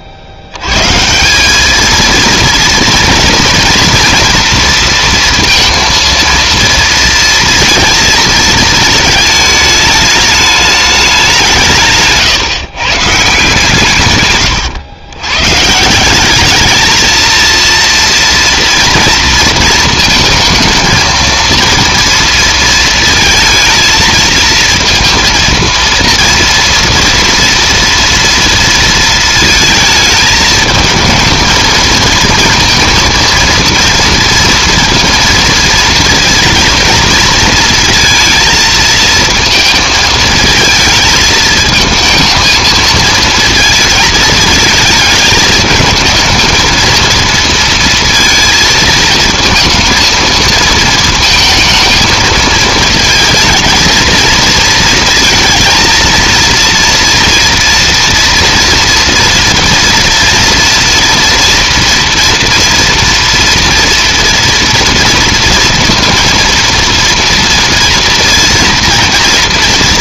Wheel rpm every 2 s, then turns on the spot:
90, 230, 230, 230, 220, 210, 140, 120, 220, 230, 230, 230, 230, 230, 230, 220, 230, 230, 230, 220, 220, 220, 220, 220, 230, 220, 220, 230, 230, 240, 230, 230, 230, 230, 230.
none